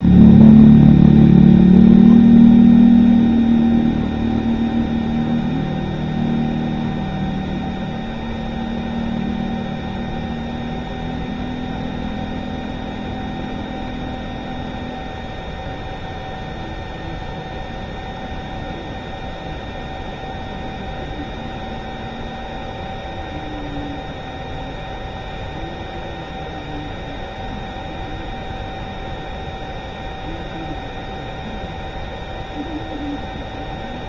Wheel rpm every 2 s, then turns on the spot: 0, 0, 0, 0, 0, 0, 0, 0, 0, 0, 0, 0, 0, 0, 0, 0, 0.
none